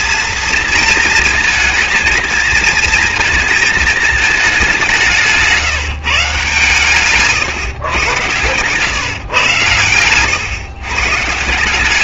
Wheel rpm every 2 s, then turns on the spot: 230, 220, 180, 150, 140, 140.
none